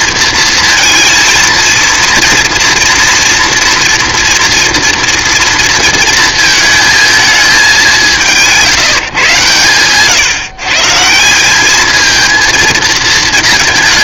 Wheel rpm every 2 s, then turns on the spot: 230, 230, 230, 220, 160, 140, 230.
none